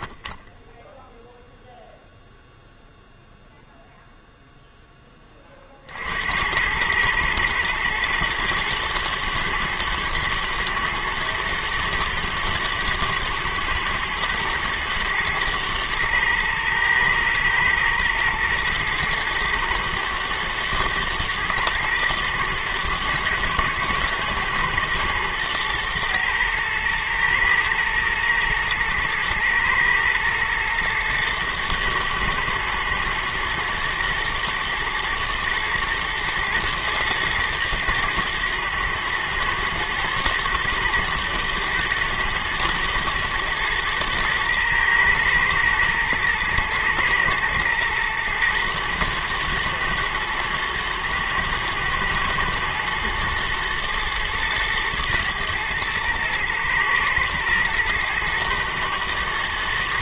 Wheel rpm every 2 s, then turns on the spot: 0, 0, 20, 110, 120, 110, 110, 120, 110, 120, 120, 120, 110, 110, 110, 120, 120, 110, 110, 110, 110, 110, 110, 110, 110, 110, 110, 120, 110, 120.
none